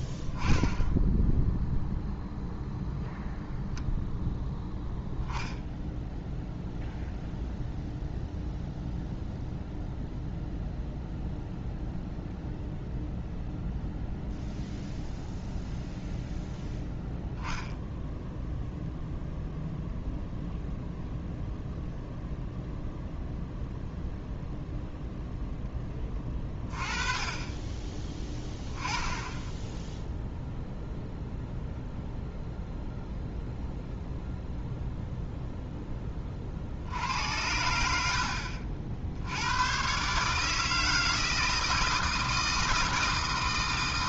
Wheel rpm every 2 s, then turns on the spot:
10, 0, 0, 0, 0, 0, 0, 0, 0, 0, 0, 0, 0, 20, 10, 0, 0, 0, 50, 50, 160, 170.
none